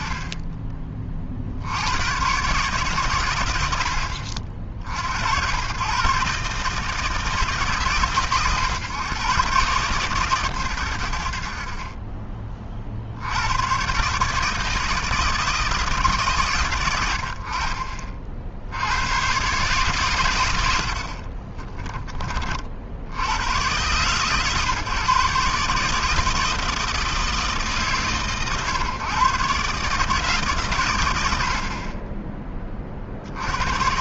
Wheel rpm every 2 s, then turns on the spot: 40, 120, 120, 140, 130, 40, 90, 160, 70, 120, 30, 80, 140, 160, 130, 100, 60.
20-22